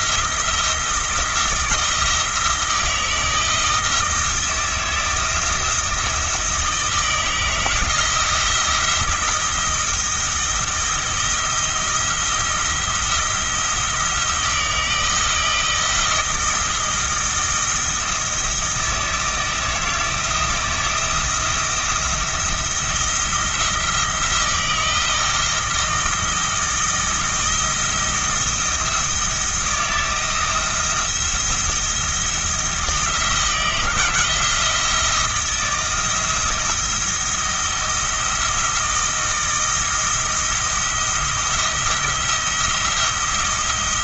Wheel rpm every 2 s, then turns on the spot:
160, 160, 160, 160, 170, 170, 170, 160, 160, 160, 170, 170, 160, 170, 170, 170, 170, 170, 170, 160, 170, 170.
none